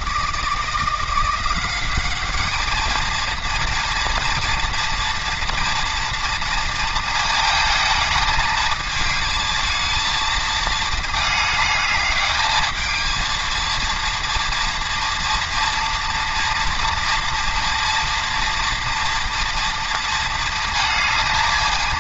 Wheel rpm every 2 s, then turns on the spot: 170, 220, 230, 230, 220, 220, 220, 230, 230, 230, 230.
none